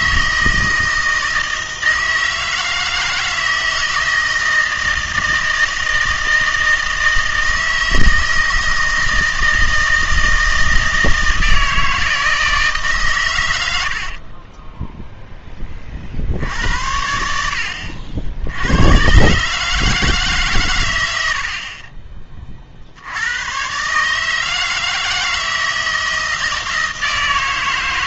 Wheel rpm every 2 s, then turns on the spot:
160, 160, 160, 160, 160, 160, 150, 10, 80, 90, 130, 40, 160, 160.
14-16